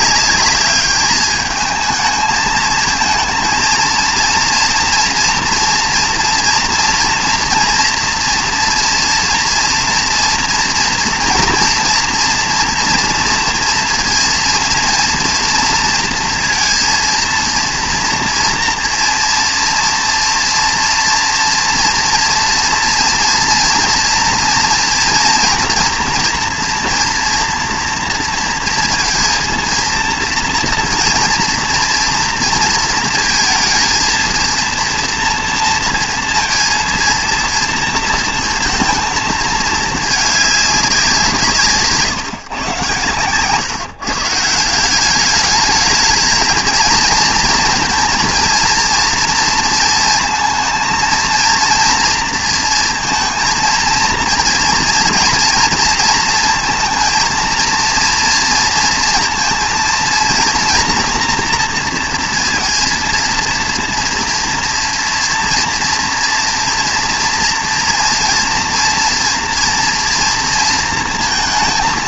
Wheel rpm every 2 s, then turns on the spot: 210, 220, 230, 230, 230, 240, 230, 230, 230, 230, 230, 230, 230, 230, 230, 230, 230, 230, 230, 230, 210, 140, 170, 230, 230, 230, 230, 230, 230, 230, 230, 230, 230, 230, 240, 230.
none